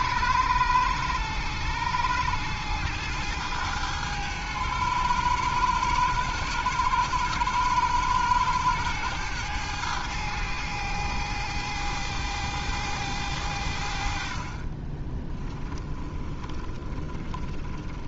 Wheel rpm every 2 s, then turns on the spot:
100, 110, 100, 100, 110, 100, 100, 30, 20.
14-18